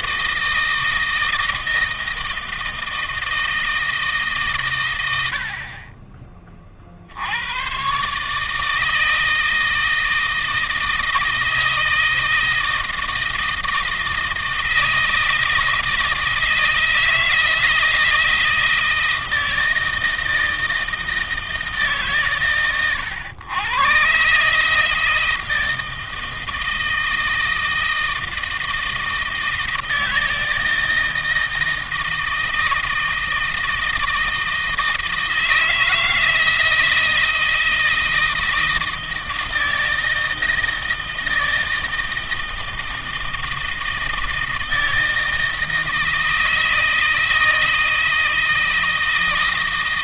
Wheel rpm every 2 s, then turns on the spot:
160, 160, 90, 60, 160, 160, 160, 160, 160, 160, 160, 120, 160, 160, 160, 160, 160, 160, 160, 160, 160, 160, 160, 160, 160.
none